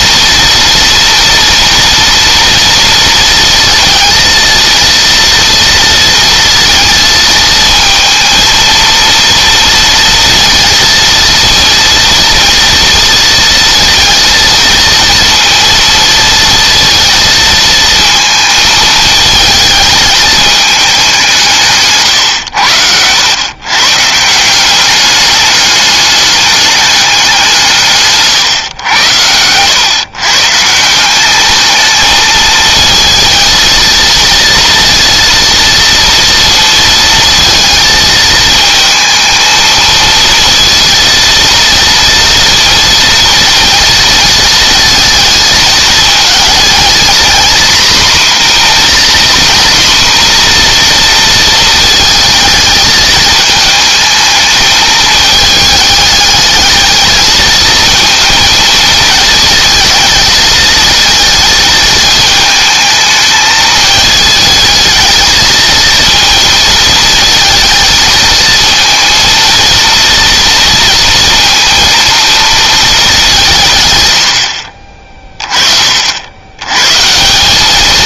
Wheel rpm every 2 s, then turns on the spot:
230, 230, 230, 230, 230, 230, 230, 230, 230, 220, 210, 100, 180, 200, 130, 140, 220, 230, 230, 220, 230, 230, 220, 230, 250, 240, 220, 220, 210, 230, 220, 220, 220, 220, 230, 230, 230, 60, 110.
none